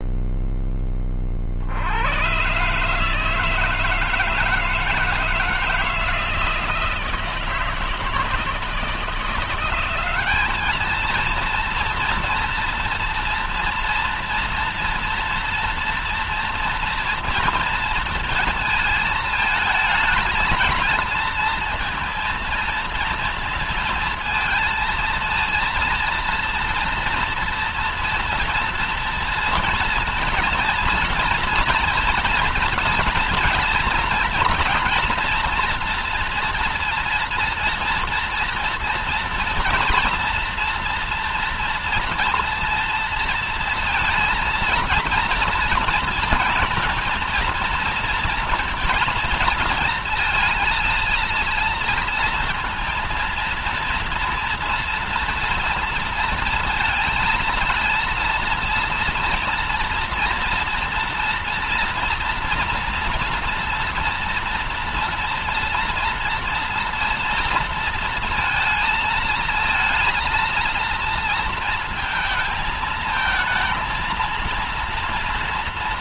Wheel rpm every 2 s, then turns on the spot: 10, 130, 160, 160, 160, 200, 230, 230, 230, 230, 220, 230, 230, 230, 230, 230, 230, 230, 230, 240, 240, 230, 230, 230, 230, 230, 230, 230, 230, 230, 230, 230, 230, 230, 230, 230, 230, 230.
none